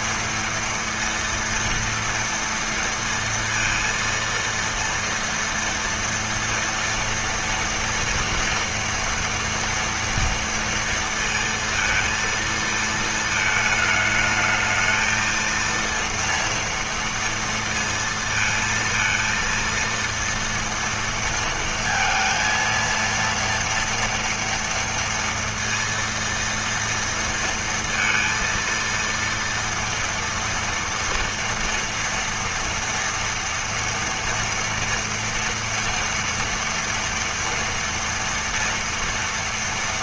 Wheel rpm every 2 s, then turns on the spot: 230, 230, 230, 230, 230, 230, 220, 220, 230, 230, 230, 230, 230, 230, 230, 230, 230, 230, 230, 230.
none